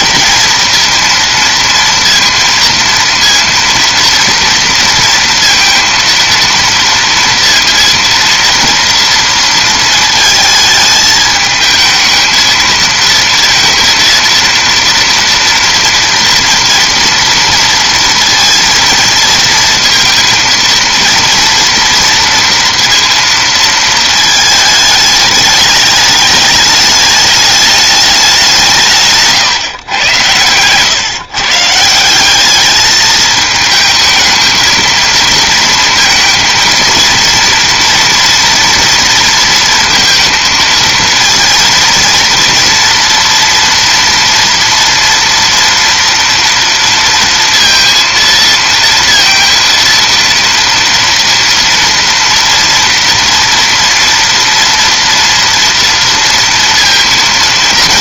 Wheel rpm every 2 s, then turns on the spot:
230, 230, 230, 230, 230, 220, 230, 230, 230, 230, 230, 230, 220, 210, 180, 120, 200, 220, 230, 230, 220, 230, 230, 230, 230, 230, 230, 230, 230.
none